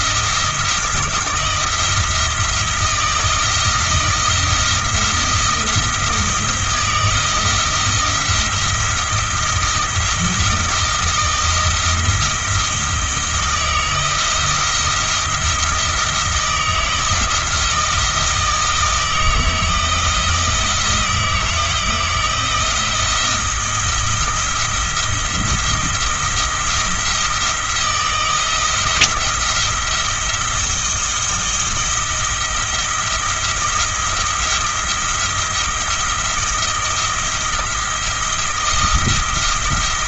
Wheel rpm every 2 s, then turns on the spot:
160, 160, 170, 160, 160, 170, 170, 170, 160, 160, 160, 170, 170, 170, 170, 170, 170, 170, 170, 170.
none